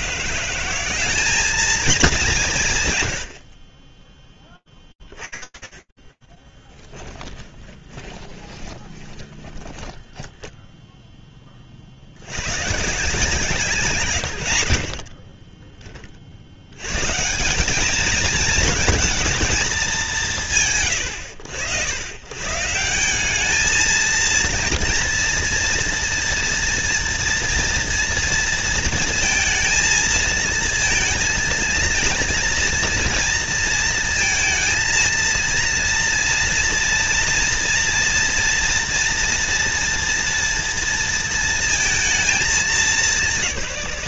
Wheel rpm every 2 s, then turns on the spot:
180, 160, 10, 10, 20, 10, 130, 80, 110, 220, 60, 180, 230, 230, 230, 230, 230, 230, 230, 230, 230, 190.
6-12